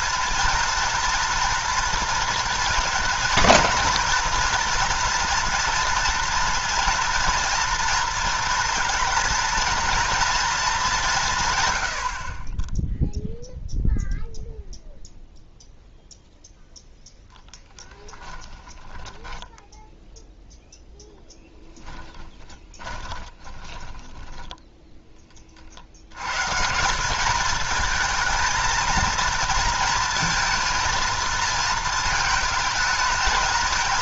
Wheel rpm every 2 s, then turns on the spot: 230, 230, 230, 230, 230, 220, 10, 0, 0, 20, 0, 20, 10, 160, 230, 230, 220.
18-20 22-24